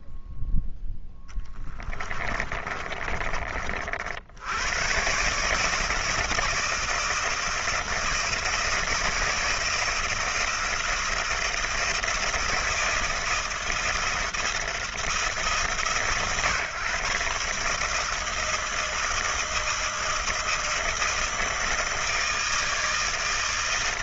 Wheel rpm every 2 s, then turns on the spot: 0, 30, 100, 160, 160, 160, 170, 160, 140, 160, 160, 160.
2-4